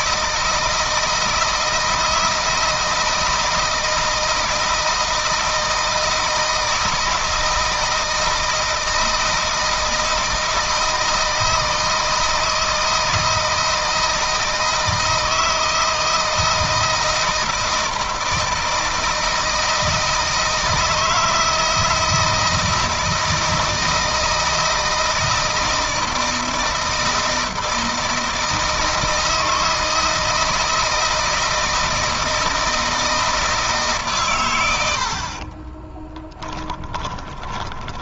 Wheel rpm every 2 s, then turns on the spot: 160, 160, 160, 160, 160, 160, 160, 160, 160, 160, 160, 160, 160, 160, 160, 160, 160, 80, 20.
36-38